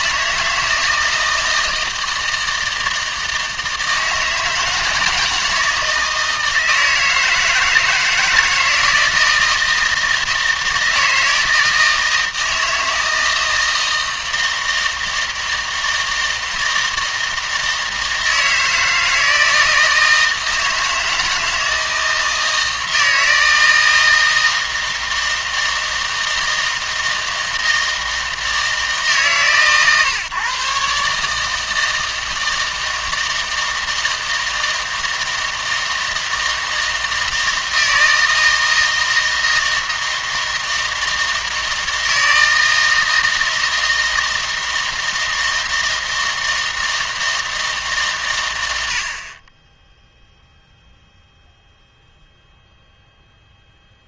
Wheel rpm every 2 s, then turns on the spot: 160, 160, 160, 160, 170, 160, 160, 160, 160, 160, 160, 160, 160, 160, 150, 140, 160, 160, 160, 160, 160, 160, 160, 160, 120, 0, 0.
none